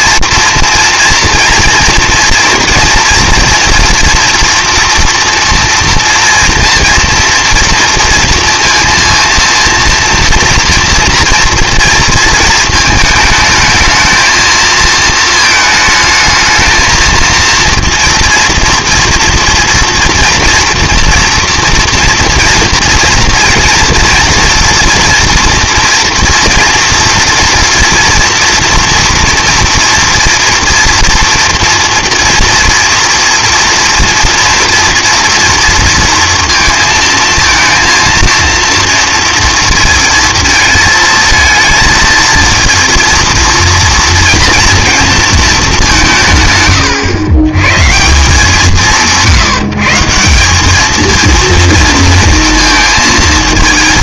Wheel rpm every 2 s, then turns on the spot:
230, 240, 230, 230, 230, 230, 220, 220, 220, 240, 230, 230, 230, 230, 240, 230, 230, 230, 230, 230, 230, 230, 230, 120, 170, 210, 230.
none